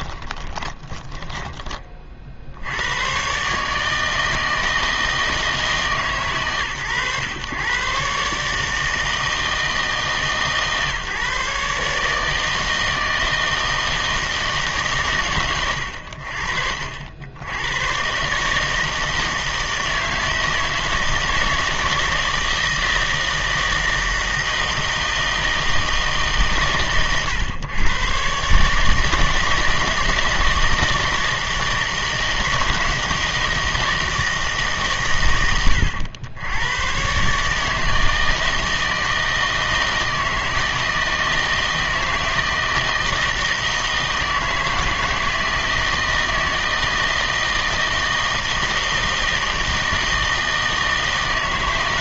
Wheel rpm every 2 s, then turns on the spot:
20, 80, 160, 120, 150, 140, 160, 150, 60, 150, 160, 160, 160, 130, 150, 170, 160, 140, 110, 160, 160, 160, 160, 160, 160, 160.
0-2